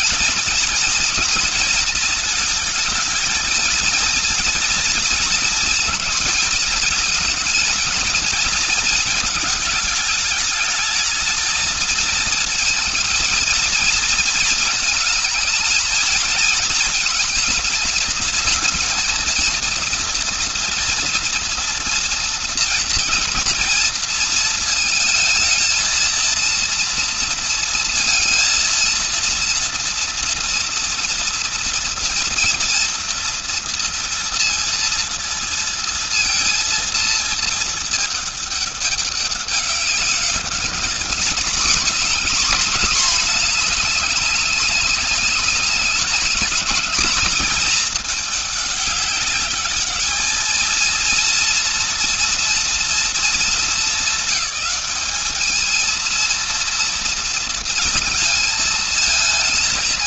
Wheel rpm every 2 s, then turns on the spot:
240, 230, 230, 220, 220, 210, 230, 220, 230, 230, 230, 240, 230, 230, 230, 230, 230, 230, 230, 210, 200, 230, 200, 220, 210, 220, 230, 220, 230, 230.
none